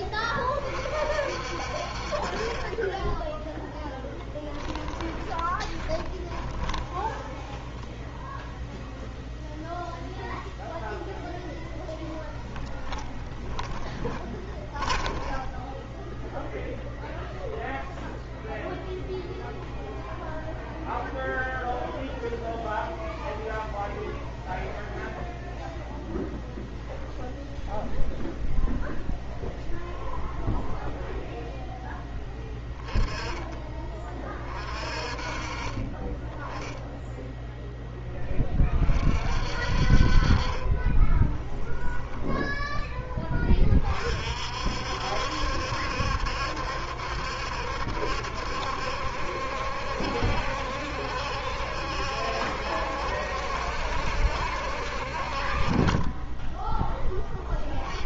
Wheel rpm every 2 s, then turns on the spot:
40, 20, 10, 20, 0, 0, 30, 10, 0, 0, 0, 0, 0, 0, 0, 0, 20, 30, 10, 30, 30, 10, 60, 70, 70, 70, 70, 60, 20.
4-8 12-16 40-42